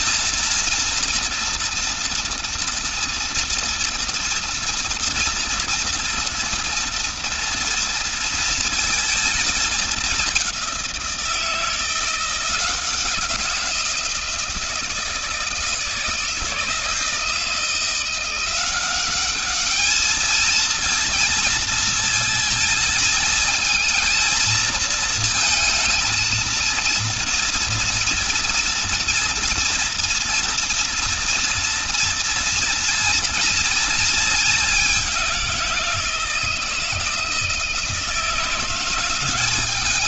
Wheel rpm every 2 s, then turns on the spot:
230, 240, 230, 230, 230, 190, 170, 160, 160, 180, 220, 230, 230, 230, 230, 240, 230, 210, 160, 170.
none